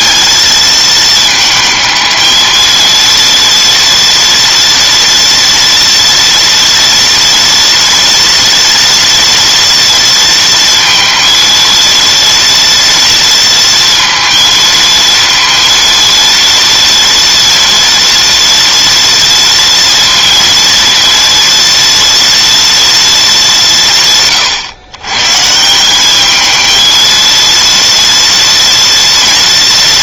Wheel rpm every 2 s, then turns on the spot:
220, 230, 230, 230, 230, 230, 230, 230, 230, 230, 230, 220, 120, 220, 230.
none